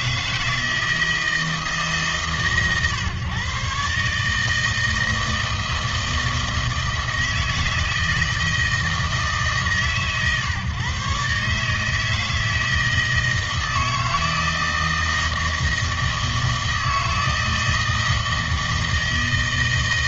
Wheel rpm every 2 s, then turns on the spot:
160, 140, 160, 160, 160, 130, 160, 160, 160, 160.
none